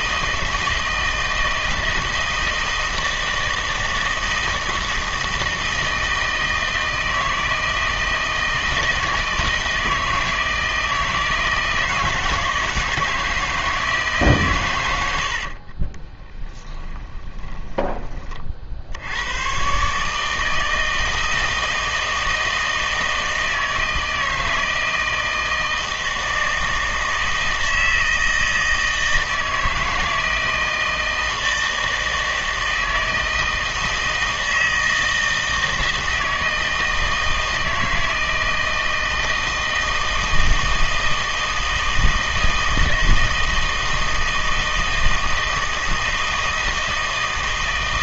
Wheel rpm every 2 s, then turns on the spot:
160, 160, 160, 160, 160, 160, 160, 120, 10, 60, 160, 160, 160, 160, 160, 160, 160, 160, 170, 160, 160, 160, 160, 160.
16-18